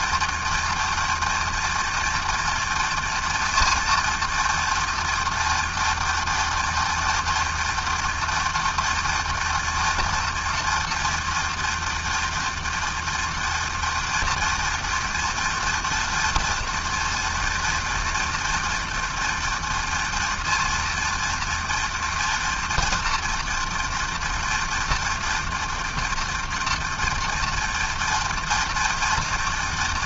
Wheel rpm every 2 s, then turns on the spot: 230, 240, 230, 230, 230, 230, 230, 230, 230, 240, 230, 240, 230, 230, 230.
none